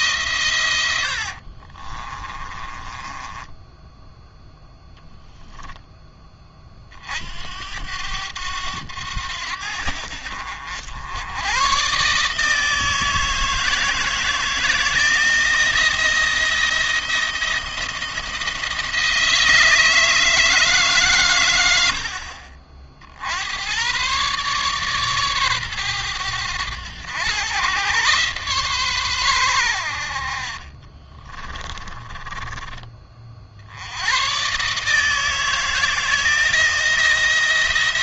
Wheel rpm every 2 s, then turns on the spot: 100, 20, 10, 40, 90, 80, 160, 160, 170, 160, 150, 60, 140, 100, 130, 40, 30, 150, 170.
0-6 30-32